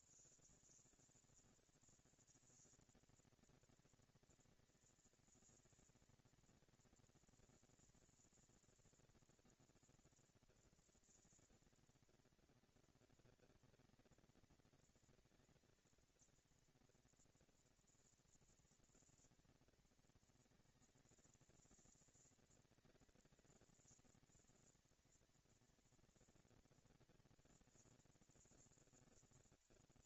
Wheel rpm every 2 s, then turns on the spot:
180, 230, 230, 230, 230, 230, 230, 230, 230, 230, 230, 230, 230, 240, 230.
none